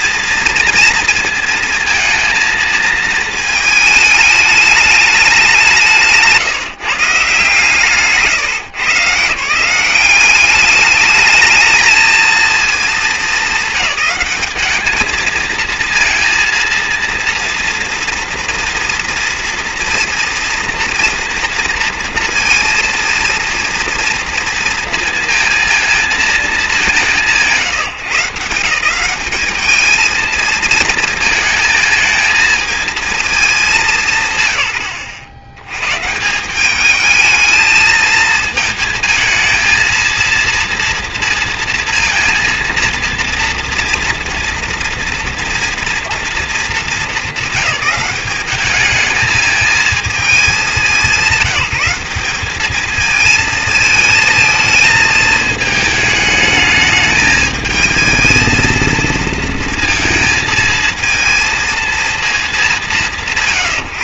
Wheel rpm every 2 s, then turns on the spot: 230, 230, 210, 160, 130, 200, 230, 220, 230, 230, 230, 230, 230, 210, 170, 230, 220, 90, 200, 220, 230, 230, 230, 220, 210, 210, 210, 220, 220, 220, 220, 200.
none